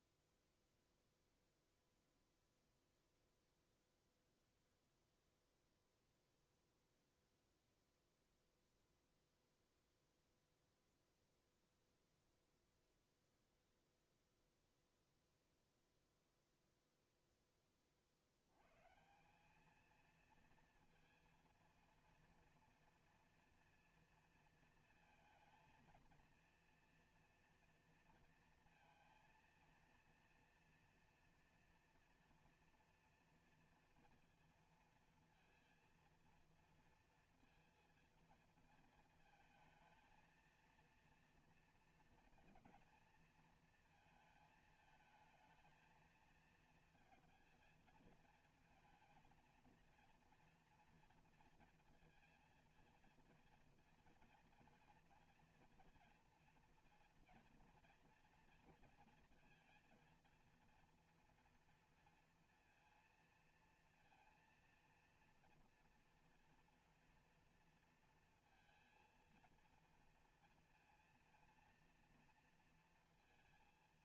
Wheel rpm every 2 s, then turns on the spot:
0, 0, 0, 0, 0, 0, 0, 0, 0, 100, 230, 230, 230, 240, 230, 240, 230, 230, 230, 230, 230, 230, 220, 230, 220, 230, 230, 230, 240, 230, 230, 230, 230, 240, 230, 230, 230.
none